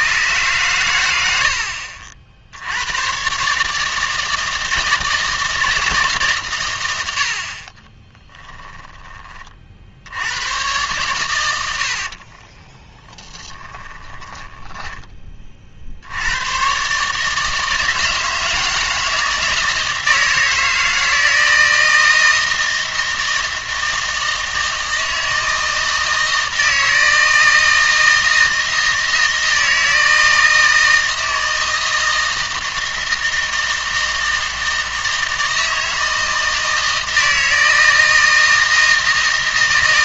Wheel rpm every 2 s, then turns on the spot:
120, 100, 160, 120, 10, 110, 20, 10, 130, 160, 160, 160, 160, 160, 160, 160, 160, 160, 160, 160.
8-10 12-16